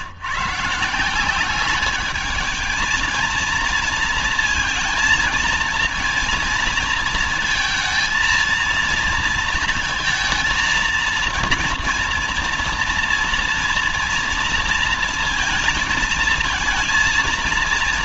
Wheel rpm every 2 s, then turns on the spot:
140, 210, 220, 220, 230, 230, 230, 230, 230.
none